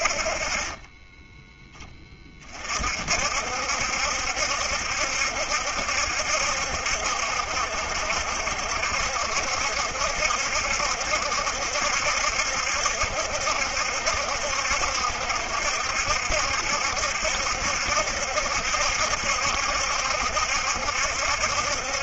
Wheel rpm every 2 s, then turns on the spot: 10, 60, 70, 70, 70, 70, 70, 70, 70, 70, 70.
none